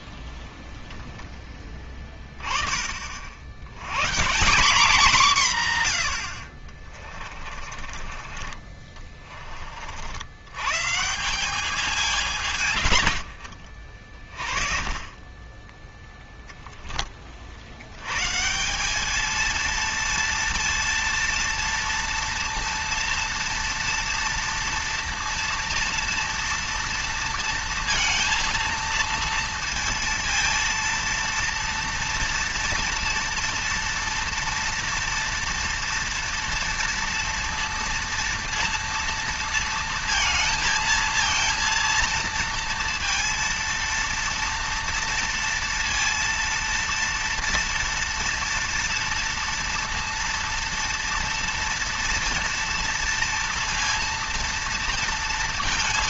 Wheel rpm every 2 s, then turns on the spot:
0, 30, 190, 50, 30, 120, 120, 30, 10, 180, 230, 230, 230, 230, 230, 230, 230, 230, 230, 230, 230, 230, 230, 230, 230, 230, 230, 230.
6-10